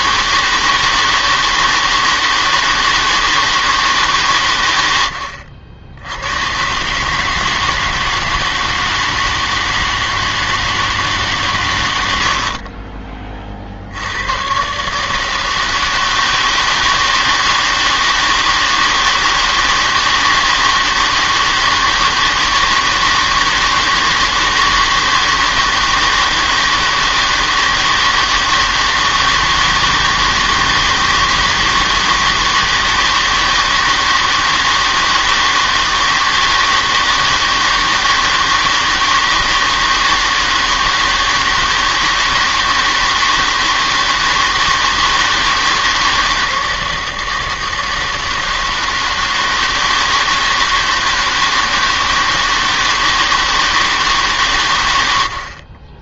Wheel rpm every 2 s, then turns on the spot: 160, 160, 110, 130, 160, 160, 50, 130, 160, 160, 160, 160, 160, 160, 160, 160, 160, 160, 160, 160, 160, 160, 160, 160, 160, 170, 160, 120.
12-14